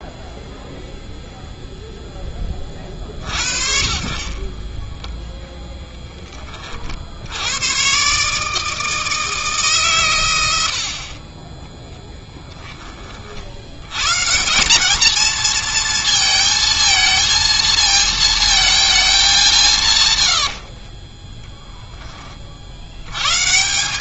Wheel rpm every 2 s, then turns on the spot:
0, 30, 20, 40, 160, 70, 10, 190, 230, 220, 90, 50.
4-6 10-12 20-22